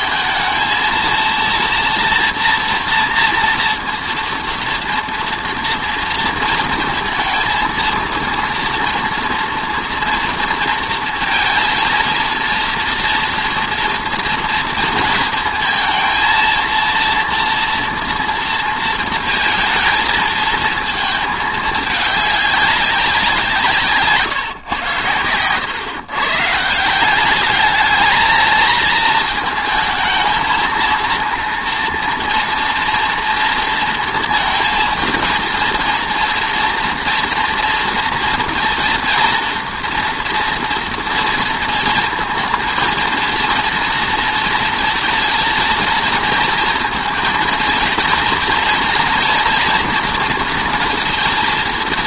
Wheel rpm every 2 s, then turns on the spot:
220, 230, 230, 230, 230, 230, 230, 230, 230, 230, 220, 200, 130, 150, 220, 230, 230, 230, 240, 240, 230, 230, 230, 230, 240, 230.
none